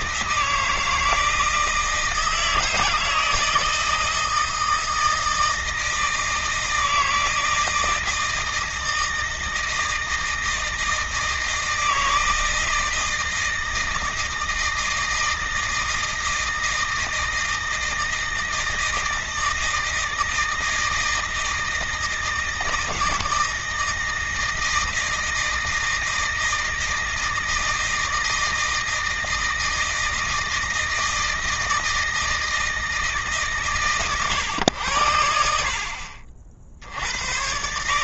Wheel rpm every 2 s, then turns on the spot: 160, 160, 160, 160, 160, 160, 160, 160, 160, 160, 160, 160, 160, 160, 160, 160, 160, 110, 60.
none